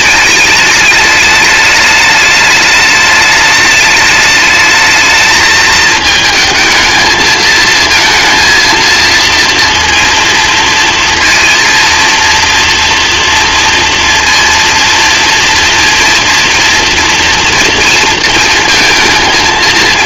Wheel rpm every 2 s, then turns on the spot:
210, 210, 210, 220, 230, 230, 230, 230, 230, 230.
none